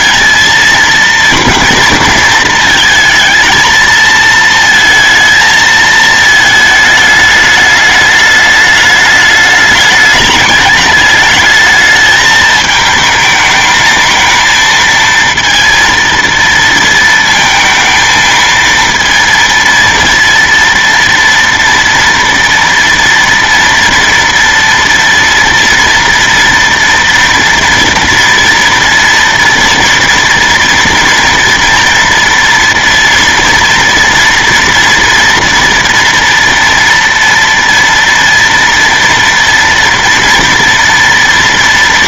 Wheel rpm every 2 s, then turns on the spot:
230, 230, 230, 220, 210, 210, 220, 230, 230, 230, 230, 230, 230, 230, 230, 230, 230, 230, 230, 230, 230.
none